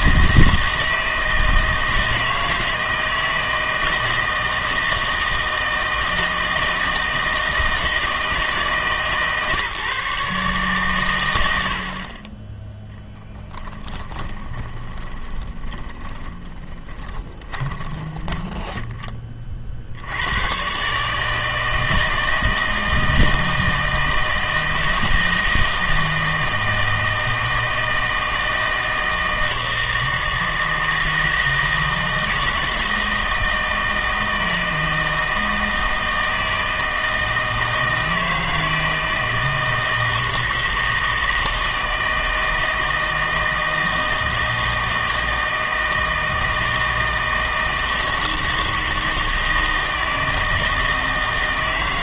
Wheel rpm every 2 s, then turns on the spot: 160, 160, 160, 160, 160, 140, 10, 10, 10, 10, 120, 160, 160, 160, 160, 160, 160, 160, 160, 160, 160, 160, 160, 160, 160, 160.
14-20